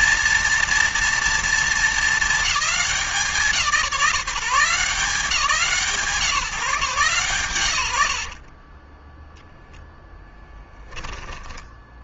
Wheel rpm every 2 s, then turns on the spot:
240, 190, 170, 140, 20, 10.
8-12